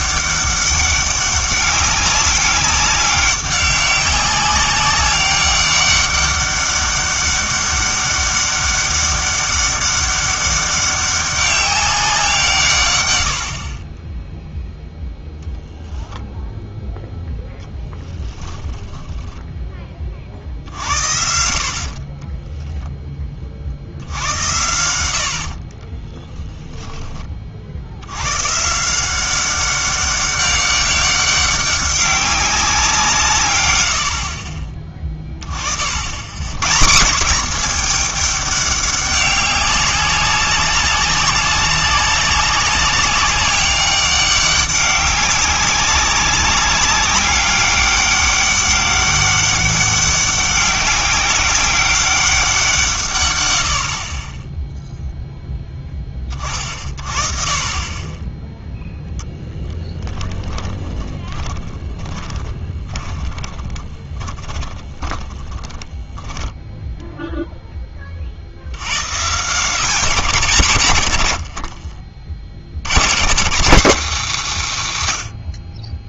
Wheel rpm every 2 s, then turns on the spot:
200, 200, 200, 200, 200, 200, 140, 0, 10, 10, 70, 10, 80, 10, 150, 200, 190, 30, 150, 200, 200, 200, 190, 190, 200, 200, 150, 0, 40, 0, 20, 20, 20, 0, 90, 130, 110, 180.
18-20 60-66